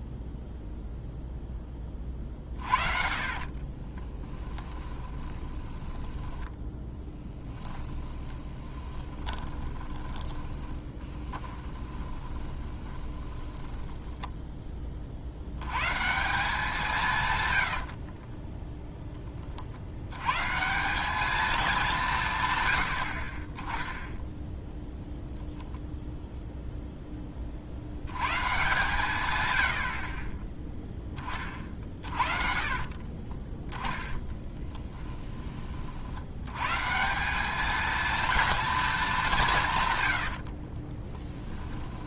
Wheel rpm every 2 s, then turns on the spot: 0, 40, 20, 10, 20, 20, 20, 30, 160, 0, 170, 90, 0, 10, 140, 10, 40, 10, 160, 230, 40.
4-14 32-36 40-42